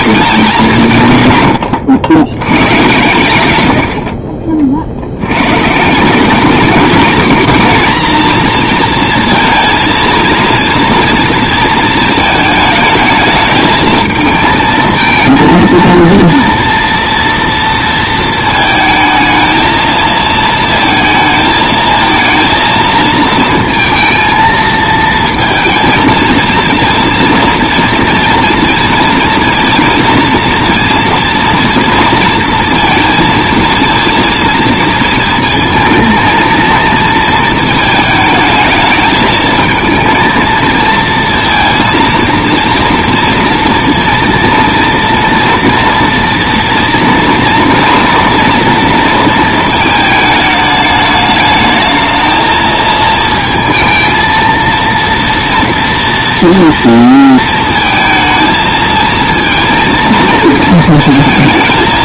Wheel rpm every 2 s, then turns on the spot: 200, 120, 50, 190, 230, 230, 220, 220, 230, 220, 220, 230, 230, 230, 230, 230, 230, 230, 230, 220, 230, 230, 230, 230, 230, 220, 220, 230, 230, 220, 230.
none